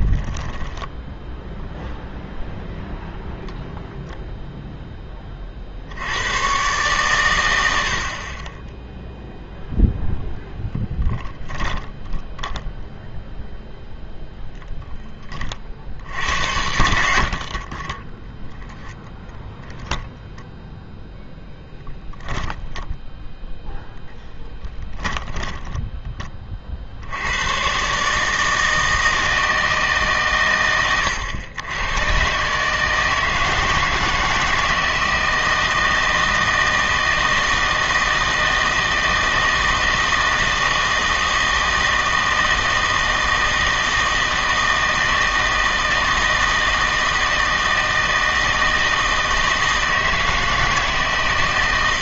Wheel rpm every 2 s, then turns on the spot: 10, 0, 10, 120, 10, 20, 0, 10, 80, 0, 0, 10, 10, 60, 160, 120, 150, 160, 160, 160, 160, 160, 160, 160, 160, 160.
0-2 10-12 16-18 22-26